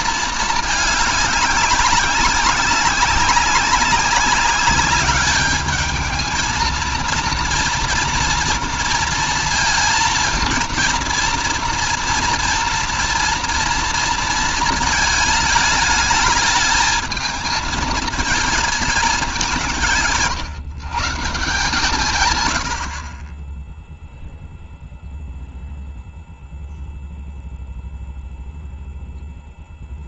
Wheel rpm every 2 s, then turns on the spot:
220, 190, 190, 220, 230, 230, 240, 230, 220, 220, 160, 100, 0, 0, 0.
none